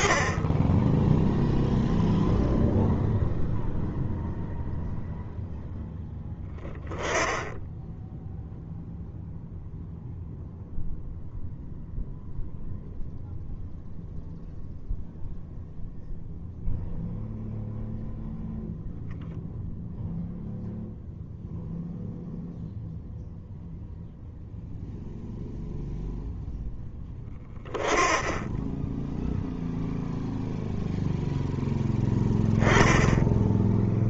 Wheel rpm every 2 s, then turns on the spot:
30, 0, 0, 10, 0, 0, 0, 0, 0, 0, 0, 0, 0, 10, 10, 0, 10.
none